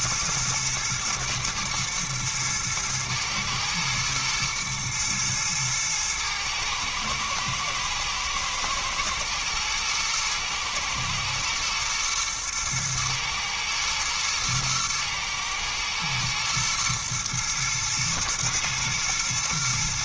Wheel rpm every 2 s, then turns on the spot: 110, 120, 120, 110, 110, 120, 120, 110, 120, 120.
none